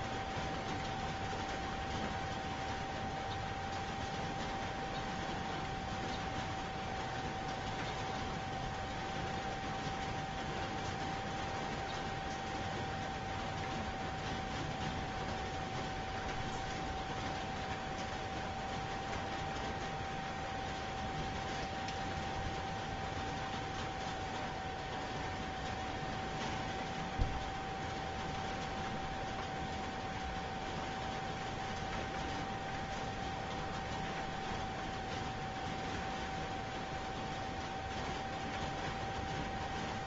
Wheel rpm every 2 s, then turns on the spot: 0, 0, 0, 0, 0, 0, 0, 0, 0, 0, 0, 0, 0, 0, 0, 0, 0, 0, 0, 0.
none